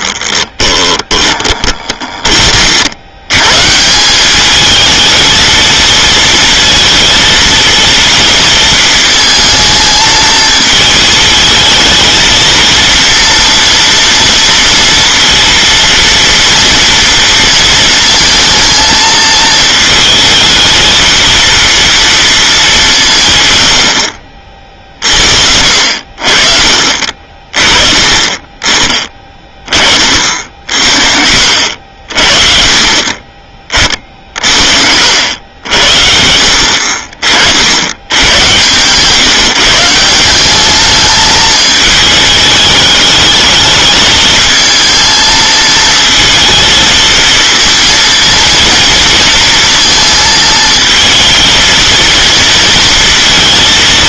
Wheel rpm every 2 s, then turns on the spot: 20, 50, 210, 230, 230, 220, 230, 230, 230, 220, 220, 210, 40, 40, 30, 50, 40, 50, 50, 120, 190, 210, 220, 230, 230, 220, 230.
0-2